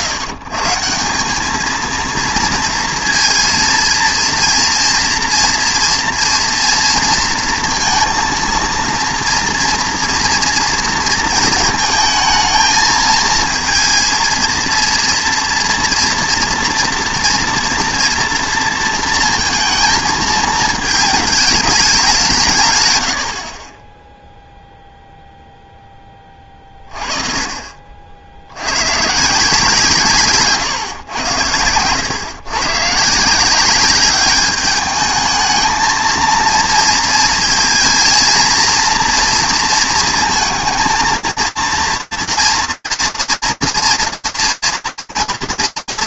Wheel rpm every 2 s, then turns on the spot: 130, 230, 230, 230, 230, 230, 220, 230, 230, 230, 220, 140, 0, 30, 100, 130, 130, 210, 230, 230, 230, 230, 230.
none